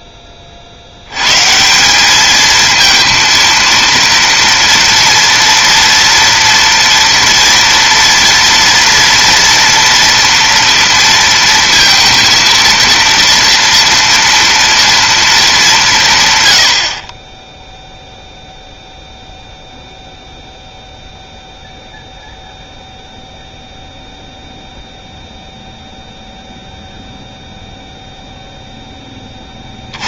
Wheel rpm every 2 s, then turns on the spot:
60, 220, 230, 230, 230, 230, 230, 230, 90, 0, 0, 0, 0, 0, 0.
none